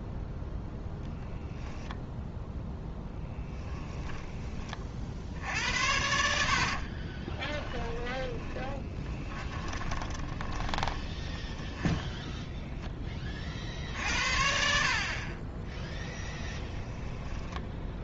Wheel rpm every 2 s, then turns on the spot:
0, 10, 40, 50, 10, 20, 10, 50, 20.
6-12 16-18